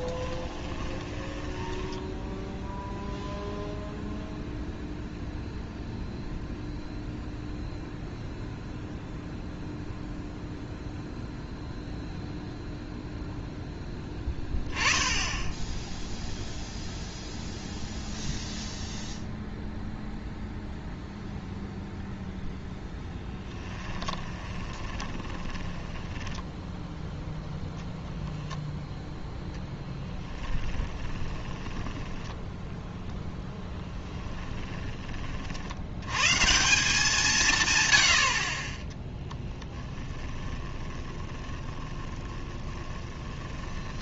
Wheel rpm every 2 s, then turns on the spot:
20, 0, 0, 0, 0, 0, 0, 10, 0, 0, 0, 0, 20, 10, 0, 20, 10, 20, 160, 30, 20, 10.
0-2 24-28 30-32 34-36 40-44